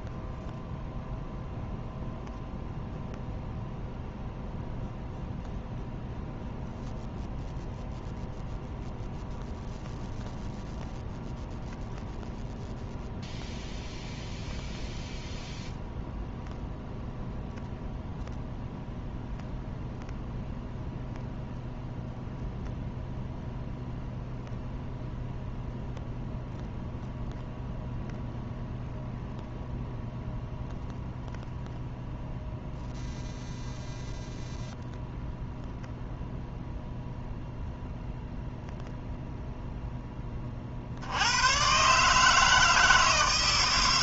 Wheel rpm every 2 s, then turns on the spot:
0, 0, 0, 0, 0, 0, 0, 0, 0, 0, 0, 0, 0, 0, 0, 0, 0, 0, 0, 0, 40, 160.
none